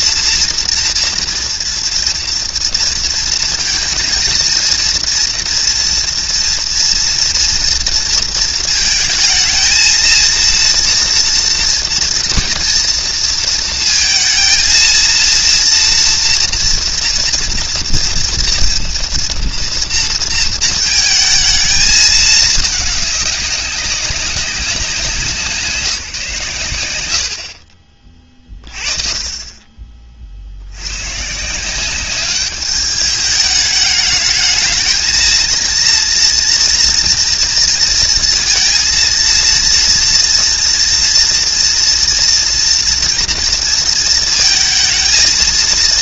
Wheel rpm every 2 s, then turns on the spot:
230, 230, 230, 230, 230, 230, 230, 230, 230, 230, 220, 210, 190, 120, 30, 60, 200, 220, 230, 230, 240, 240, 230.
none